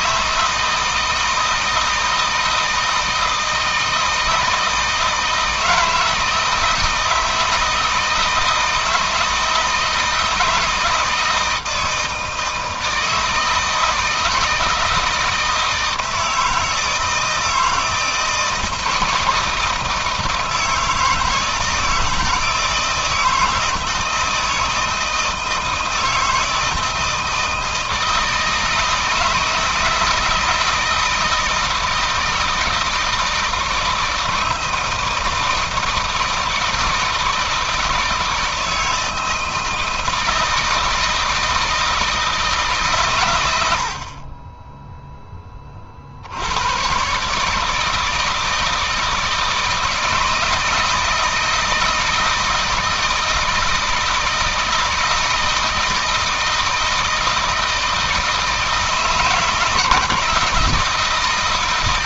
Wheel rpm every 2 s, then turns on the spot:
160, 160, 160, 160, 160, 160, 160, 160, 160, 160, 160, 160, 160, 160, 160, 160, 160, 160, 160, 160, 160, 150, 30, 100, 160, 160, 160, 160, 160, 160, 160.
none